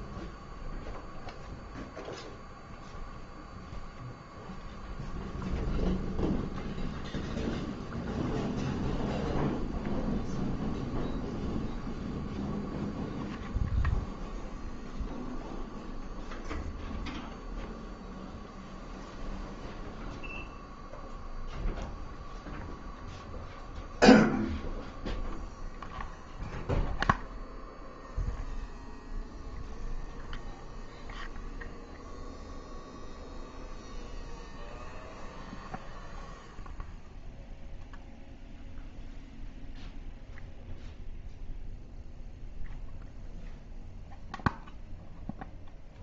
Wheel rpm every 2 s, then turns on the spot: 0, 0, 0, 0, 0, 0, 0, 0, 0, 0, 0, 0, 0, 0, 0, 0, 0, 0, 0, 0, 0, 0, 0.
none